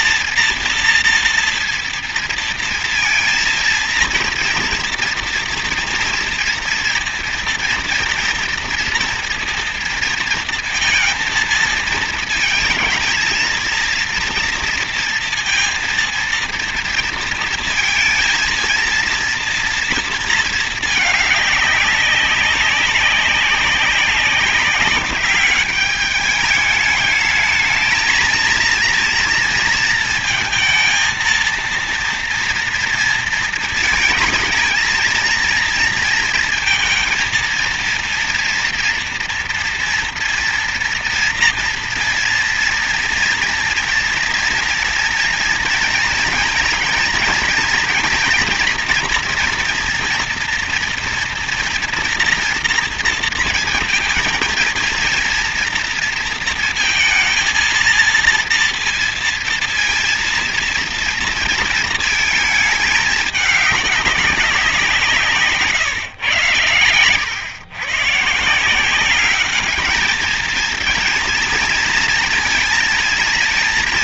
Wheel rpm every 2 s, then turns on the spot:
230, 230, 230, 230, 230, 230, 230, 230, 230, 230, 220, 190, 200, 210, 230, 230, 230, 230, 230, 230, 240, 230, 240, 230, 230, 230, 230, 230, 230, 230, 230, 220, 190, 110, 170, 220, 230.
none